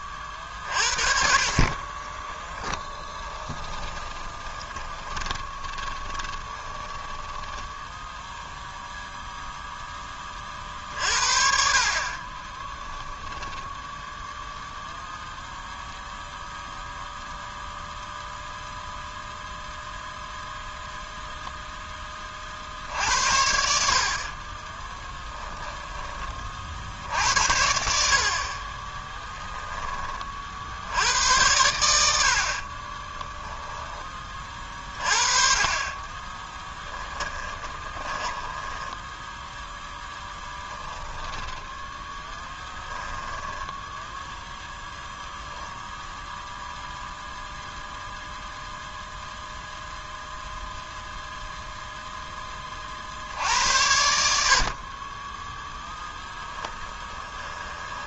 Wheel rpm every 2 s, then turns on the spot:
40, 10, 20, 20, 0, 40, 10, 0, 0, 0, 0, 60, 20, 50, 40, 70, 30, 30, 10, 10, 20, 10, 0, 0, 0, 0, 30, 50, 20.
2-8 12-14 24-26 28-30 32-34 36-40 56-58